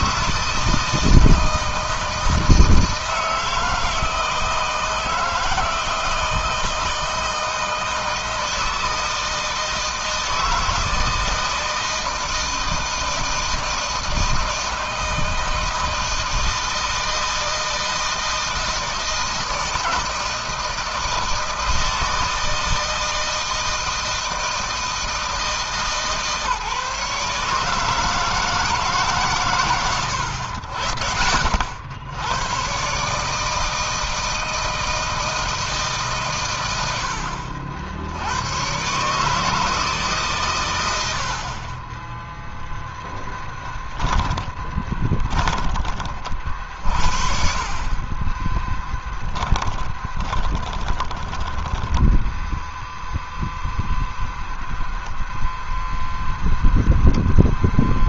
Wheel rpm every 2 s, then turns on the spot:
160, 160, 160, 160, 160, 160, 160, 160, 160, 160, 160, 160, 170, 150, 160, 90, 100, 160, 120, 90, 130, 0, 20, 40, 20, 20, 10, 10, 0.
44-46 48-54